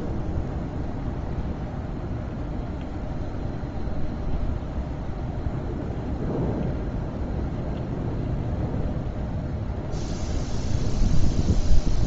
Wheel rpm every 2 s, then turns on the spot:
0, 0, 0, 0, 0, 0.
none